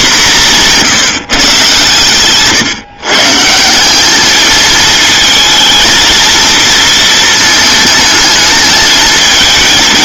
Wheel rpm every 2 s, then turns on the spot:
180, 140, 220, 230, 220.
none